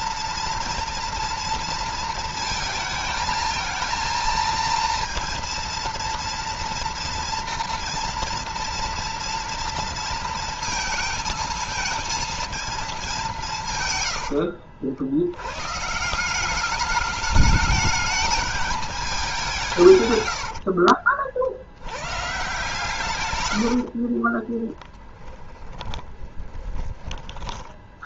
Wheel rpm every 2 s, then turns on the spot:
230, 220, 230, 230, 230, 230, 210, 60, 200, 210, 70, 140, 10, 30.
20-22 24-26